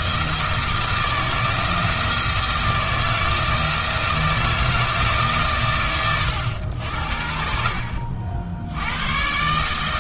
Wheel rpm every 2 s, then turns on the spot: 160, 160, 160, 80, 90.
none